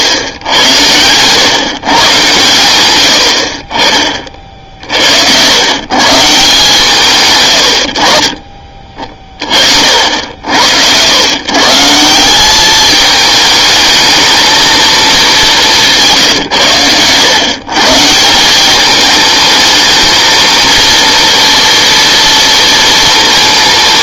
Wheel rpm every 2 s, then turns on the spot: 100, 110, 50, 150, 30, 80, 210, 220, 120, 190, 230, 230.
none